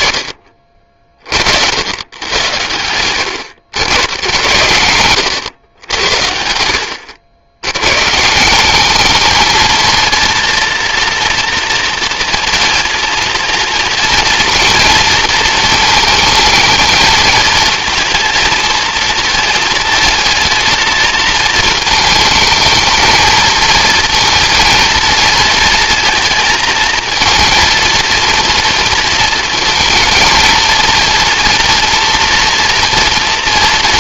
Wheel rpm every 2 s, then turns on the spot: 70, 100, 110, 100, 220, 230, 230, 230, 230, 230, 220, 230, 220, 230, 220, 230, 230.
none